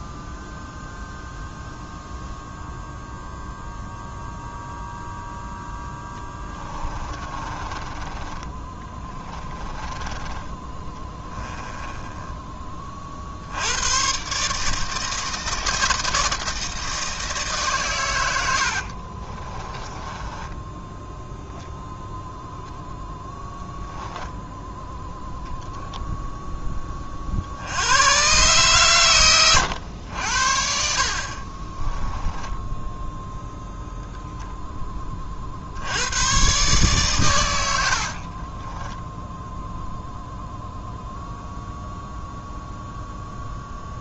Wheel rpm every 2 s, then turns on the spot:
0, 0, 0, 20, 20, 10, 30, 150, 160, 60, 10, 0, 0, 20, 120, 60, 10, 10, 140, 20, 0, 0.
6-10 18-22 32-34 38-40